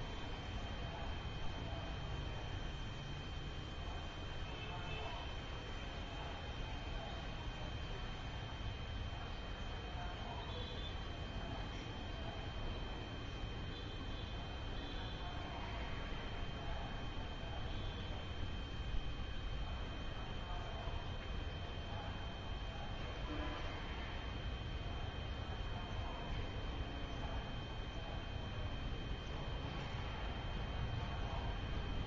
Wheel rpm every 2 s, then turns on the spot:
0, 0, 0, 0, 0, 0, 0, 0, 0, 0, 0, 0, 0, 0, 0, 0.
none